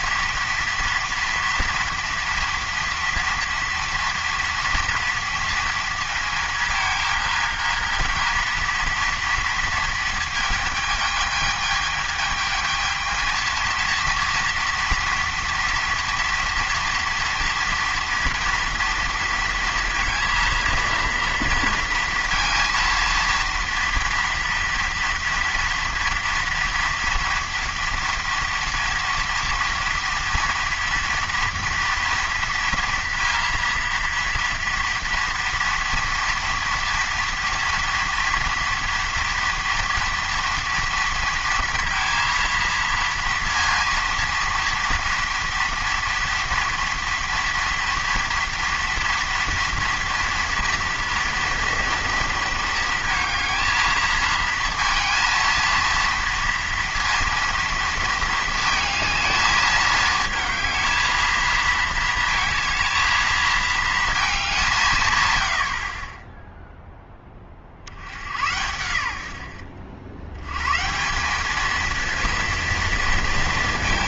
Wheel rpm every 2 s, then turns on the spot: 230, 230, 230, 220, 230, 220, 220, 230, 230, 230, 230, 230, 230, 230, 230, 240, 230, 230, 230, 230, 230, 230, 230, 230, 230, 230, 230, 230, 230, 220, 220, 220, 180, 0, 90, 120, 230.
none